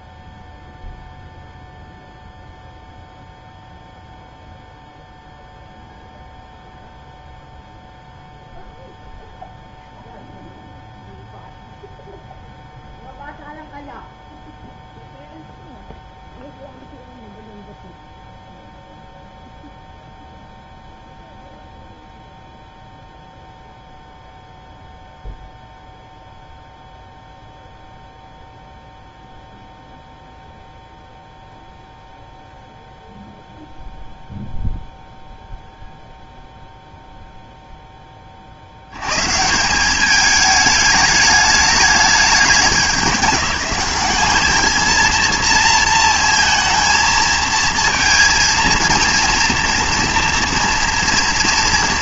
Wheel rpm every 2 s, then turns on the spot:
0, 0, 0, 0, 0, 0, 0, 0, 0, 0, 0, 0, 0, 0, 0, 0, 0, 0, 0, 70, 210, 200, 220, 230, 230, 230.
none